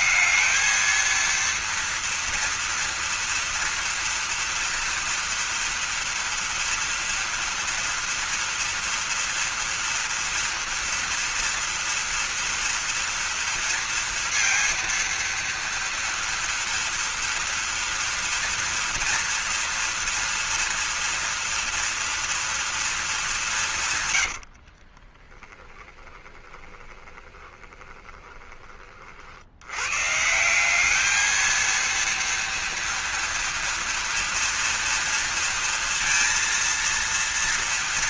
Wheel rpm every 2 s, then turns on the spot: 230, 230, 230, 230, 230, 230, 230, 230, 230, 230, 230, 230, 40, 20, 40, 210, 230, 230, 230.
24-28